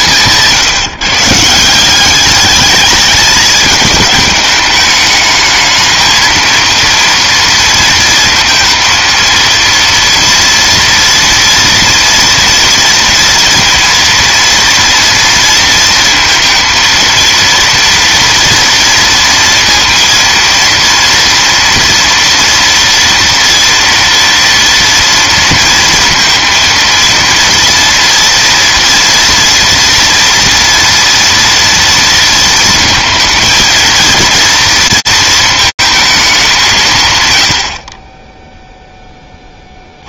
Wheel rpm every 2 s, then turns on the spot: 160, 210, 210, 230, 230, 240, 230, 230, 230, 230, 240, 240, 230, 230, 230, 230, 230, 230, 130, 10.
none